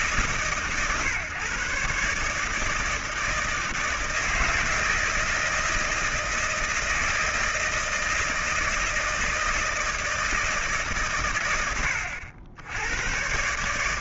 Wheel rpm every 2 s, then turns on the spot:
140, 160, 160, 160, 160, 130, 100.
none